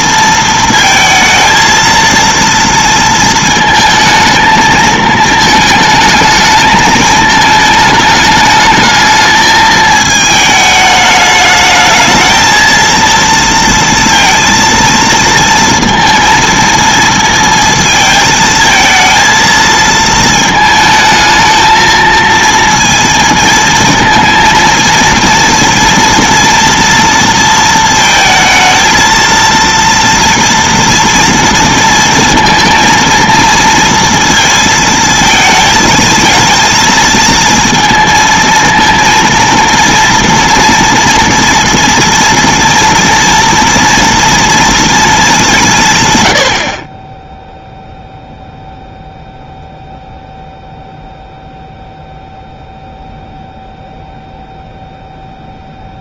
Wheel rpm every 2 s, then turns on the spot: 220, 230, 220, 220, 210, 210, 230, 230, 230, 220, 220, 230, 230, 230, 220, 230, 230, 230, 230, 230, 230, 230, 230, 60, 0, 0, 0, 0.
none